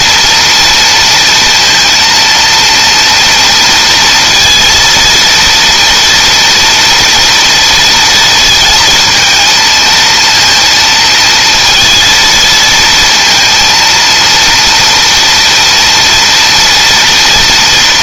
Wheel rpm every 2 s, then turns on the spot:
230, 230, 230, 230, 220, 230, 230, 230, 240.
none